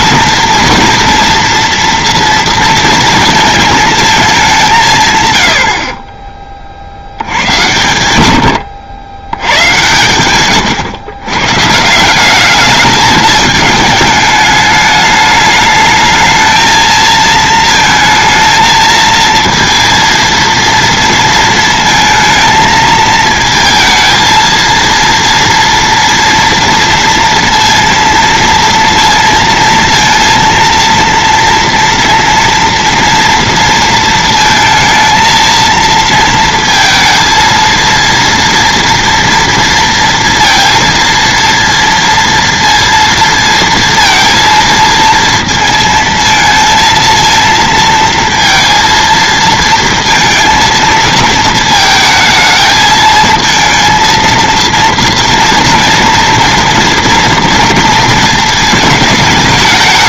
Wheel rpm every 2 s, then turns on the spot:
230, 230, 170, 50, 90, 130, 210, 210, 220, 230, 230, 220, 230, 230, 230, 230, 230, 230, 230, 230, 230, 230, 230, 230, 230, 220, 220, 230, 230, 220.
10-12